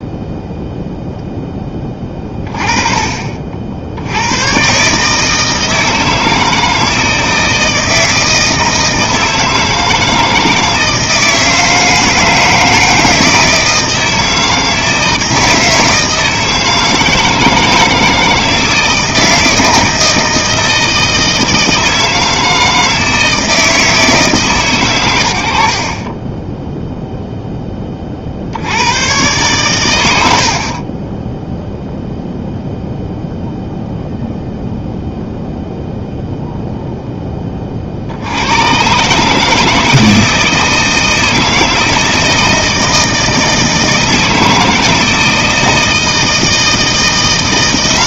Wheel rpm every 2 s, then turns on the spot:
0, 30, 120, 160, 160, 160, 160, 160, 160, 160, 160, 160, 120, 0, 70, 70, 0, 0, 0, 100, 160, 160, 160, 160.
none